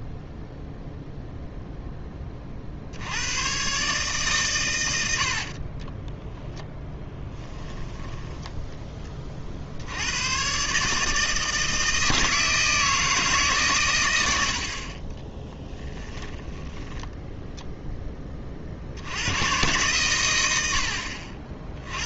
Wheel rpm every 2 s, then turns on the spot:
0, 40, 110, 0, 10, 130, 160, 60, 10, 40, 70.
16-18